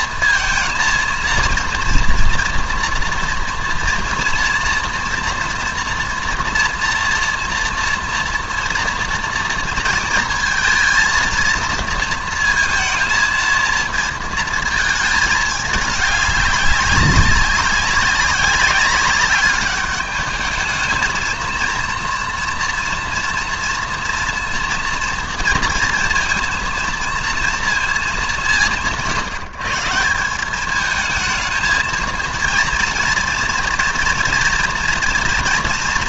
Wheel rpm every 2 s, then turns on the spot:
220, 230, 240, 230, 230, 230, 230, 220, 200, 200, 210, 230, 230, 230, 190, 200, 230, 230.
none